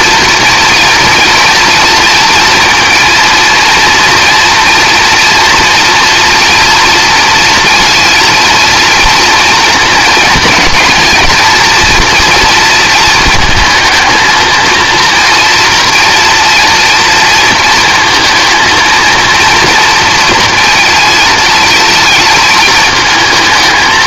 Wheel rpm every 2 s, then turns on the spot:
230, 230, 230, 230, 230, 220, 220, 230, 230, 230, 230, 220.
none